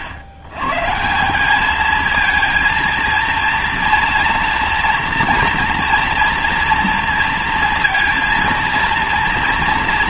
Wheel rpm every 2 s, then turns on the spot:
110, 230, 230, 230, 230.
none